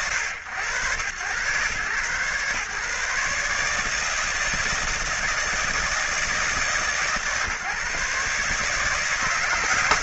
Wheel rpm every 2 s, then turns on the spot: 120, 130, 160, 150, 150.
none